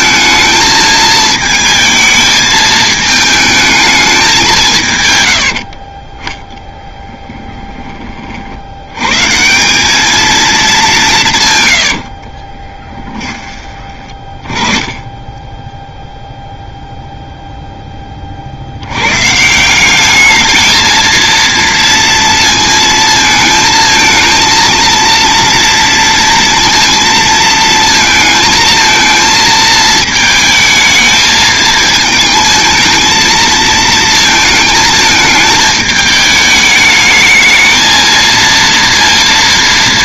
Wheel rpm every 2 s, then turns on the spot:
220, 220, 150, 10, 80, 200, 20, 20, 0, 70, 220, 220, 230, 230, 230, 220, 220, 220, 210, 230.
12-14